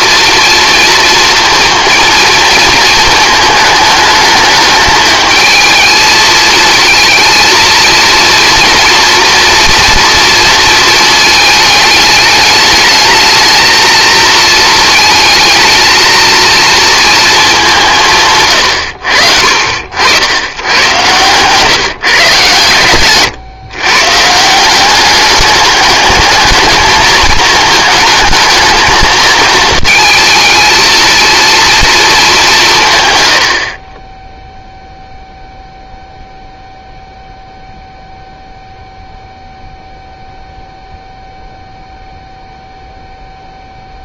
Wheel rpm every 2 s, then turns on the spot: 230, 230, 220, 220, 230, 230, 210, 220, 230, 110, 100, 130, 180, 220, 220, 220, 180, 0, 0, 0, 0, 0.
none